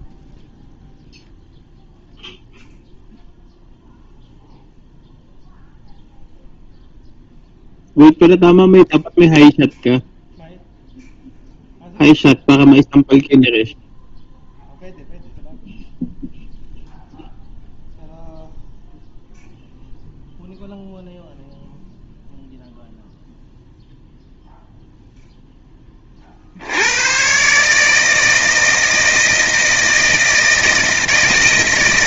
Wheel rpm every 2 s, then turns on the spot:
0, 0, 0, 0, 0, 0, 0, 0, 0, 0, 0, 0, 0, 70, 160, 160.
none